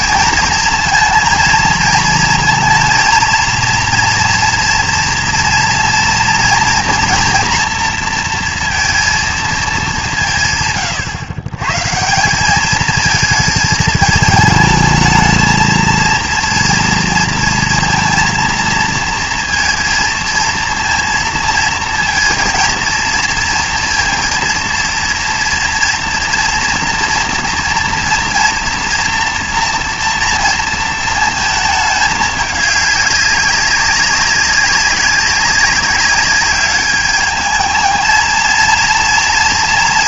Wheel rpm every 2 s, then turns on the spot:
230, 230, 230, 240, 230, 130, 210, 220, 230, 230, 230, 230, 230, 240, 230, 230, 200, 200, 210, 230.
none